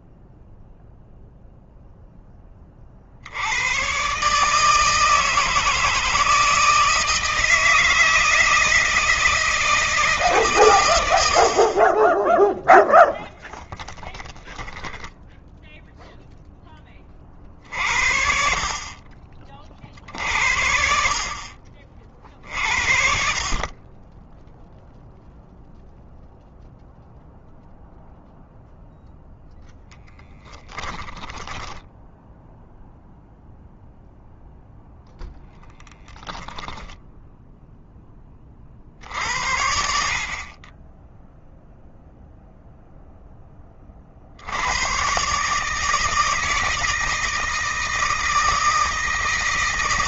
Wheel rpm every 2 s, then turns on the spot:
0, 50, 160, 160, 160, 100, 0, 10, 30, 40, 60, 60, 0, 0, 0, 10, 0, 0, 10, 50, 20, 0, 110, 160, 160.
30-32